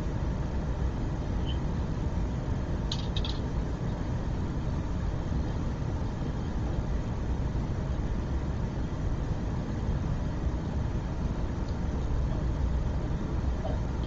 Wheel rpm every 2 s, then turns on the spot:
0, 0, 0, 0, 0, 0, 0.
none